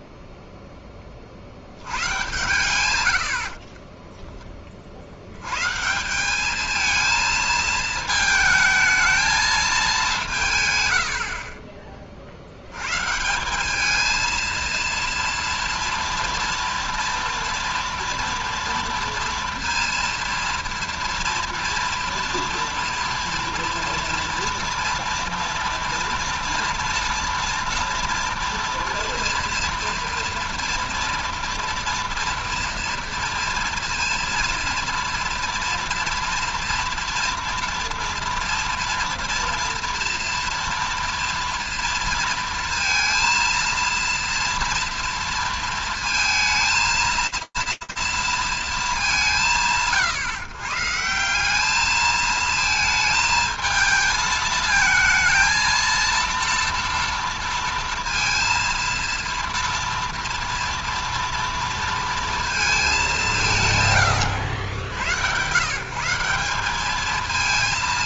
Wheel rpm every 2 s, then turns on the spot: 0, 130, 20, 210, 220, 160, 80, 230, 230, 230, 230, 230, 230, 230, 230, 230, 230, 230, 230, 230, 230, 230, 230, 230, 180, 170, 220, 220, 230, 230, 230, 200, 80, 200.
none